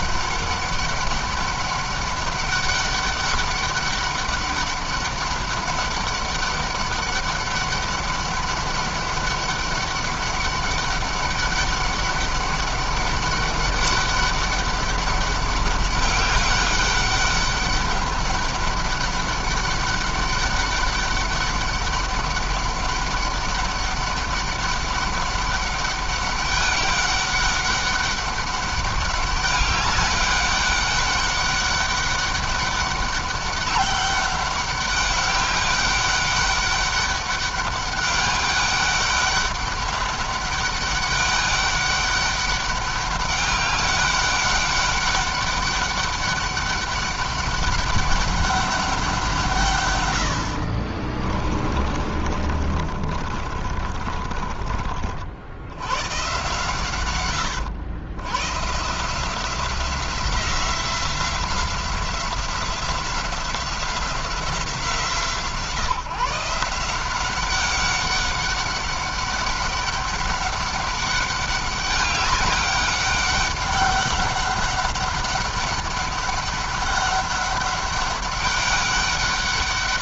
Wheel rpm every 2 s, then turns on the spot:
200, 200, 200, 200, 200, 200, 200, 200, 200, 200, 200, 200, 200, 200, 200, 200, 200, 200, 200, 200, 200, 200, 200, 200, 200, 50, 30, 40, 140, 130, 180, 180, 180, 180, 200, 200, 200, 200, 200, 200.
50-54